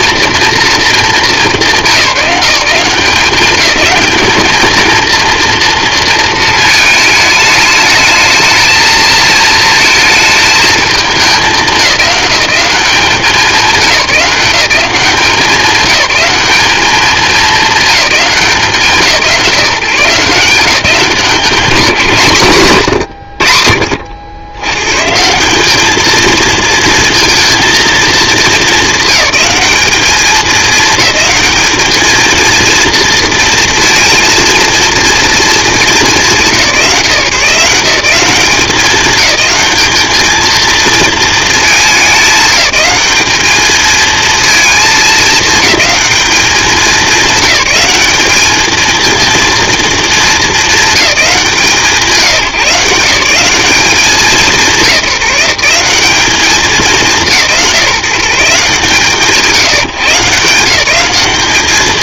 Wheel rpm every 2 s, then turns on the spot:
220, 180, 220, 220, 220, 220, 200, 190, 210, 160, 170, 120, 110, 230, 210, 210, 230, 230, 170, 210, 230, 200, 220, 200, 220, 210, 180, 180, 190, 160, 180.
none